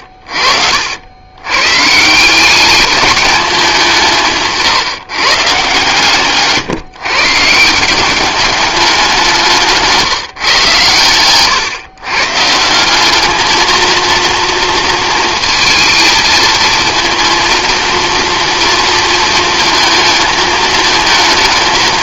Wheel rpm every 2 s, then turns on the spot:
70, 200, 150, 150, 200, 120, 160, 230, 220, 230, 220.
none